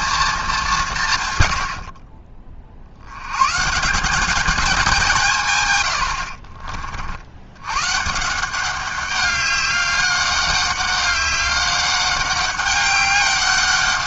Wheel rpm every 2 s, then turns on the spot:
190, 50, 200, 40, 180, 200, 200.
none